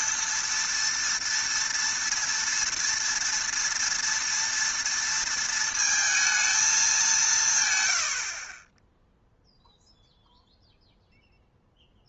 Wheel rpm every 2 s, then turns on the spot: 230, 230, 230, 220, 40, 0.
none